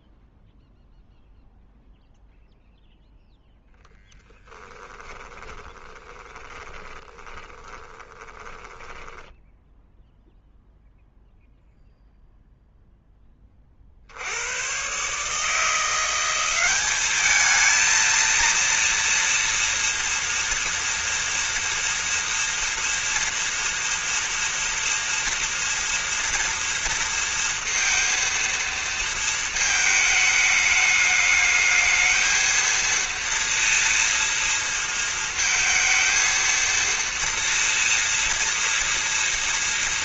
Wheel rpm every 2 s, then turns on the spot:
0, 0, 10, 20, 20, 0, 0, 90, 190, 230, 230, 240, 230, 230, 230, 210, 220, 230, 230, 230.
4-10